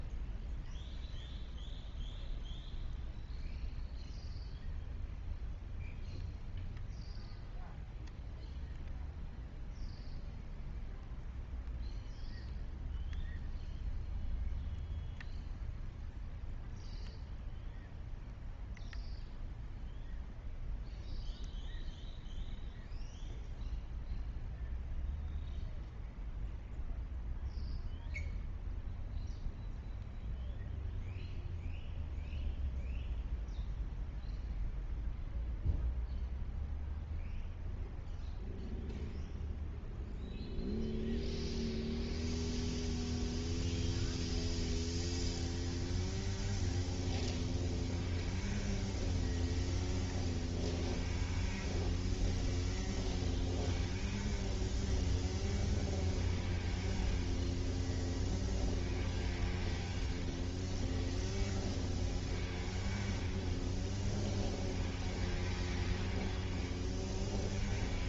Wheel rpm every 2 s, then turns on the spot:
0, 0, 0, 0, 0, 0, 0, 0, 0, 0, 0, 0, 0, 0, 0, 0, 0, 0, 0, 0, 0, 0, 0, 0, 0, 0, 0, 0, 0, 0, 0, 0, 0, 0.
none